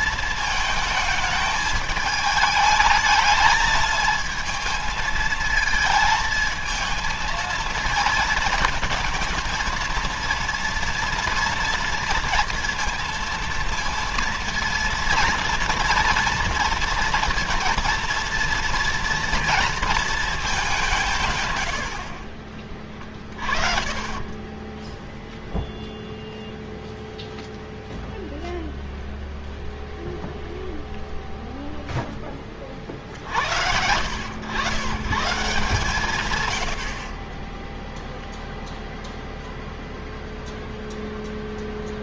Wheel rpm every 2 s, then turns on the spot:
220, 220, 220, 220, 230, 230, 230, 230, 230, 230, 170, 30, 10, 0, 0, 0, 40, 140, 60, 0, 0.
none